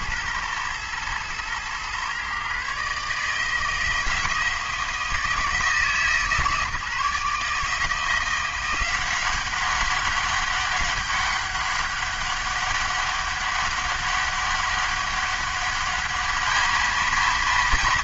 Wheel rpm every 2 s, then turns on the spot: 110, 140, 160, 150, 180, 200, 200, 200, 220.
none